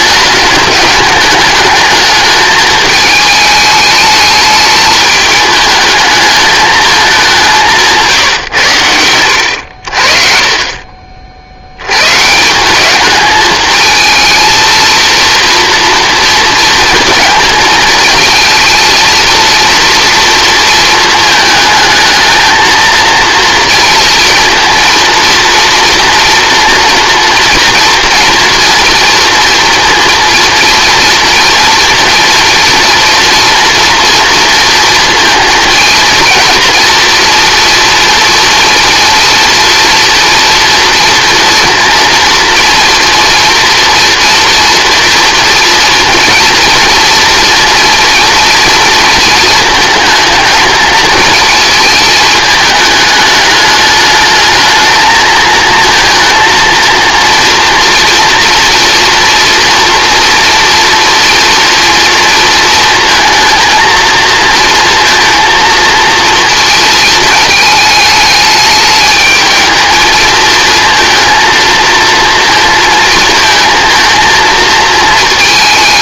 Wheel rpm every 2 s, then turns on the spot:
200, 220, 210, 210, 100, 30, 190, 230, 230, 230, 230, 220, 230, 240, 240, 230, 240, 230, 230, 230, 230, 230, 230, 230, 230, 220, 220, 220, 230, 230, 230, 230, 230, 230, 210, 220, 230, 230.
8-10